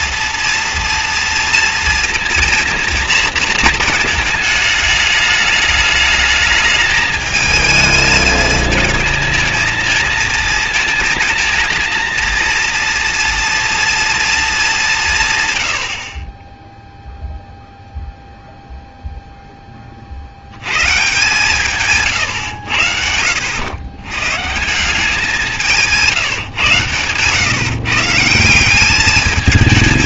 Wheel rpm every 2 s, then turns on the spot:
230, 230, 210, 210, 220, 230, 230, 220, 20, 0, 90, 110, 130, 160, 170.
26-28